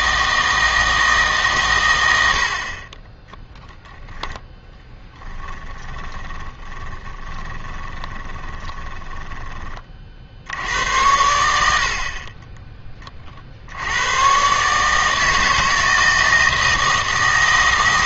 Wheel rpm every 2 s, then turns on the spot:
160, 30, 10, 20, 20, 70, 20, 140, 160.
6-10